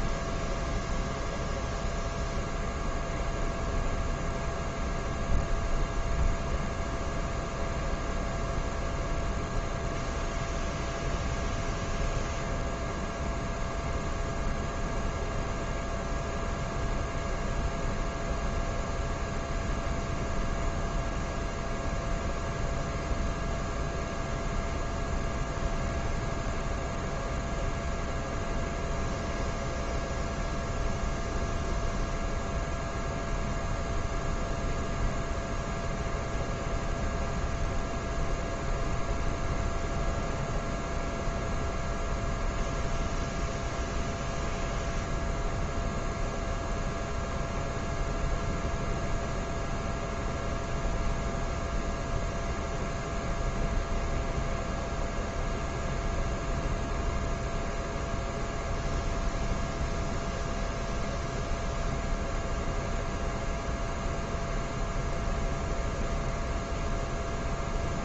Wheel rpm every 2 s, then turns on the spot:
0, 0, 0, 0, 0, 0, 0, 0, 0, 0, 0, 0, 0, 0, 0, 0, 0, 0, 0, 0, 0, 0, 0, 0, 0, 0, 0, 0, 0, 0, 0, 0, 0, 0.
none